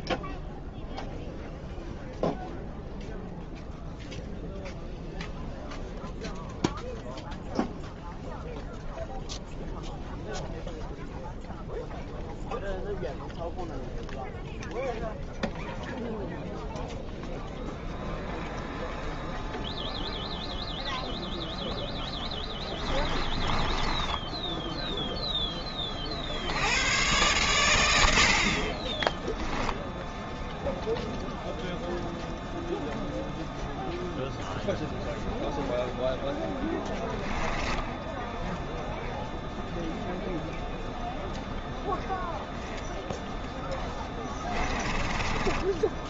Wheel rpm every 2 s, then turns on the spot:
0, 0, 0, 0, 0, 0, 0, 0, 0, 0, 0, 10, 0, 90, 40, 0, 0, 0, 10, 0, 0, 0, 10.
22-24 36-38 44-46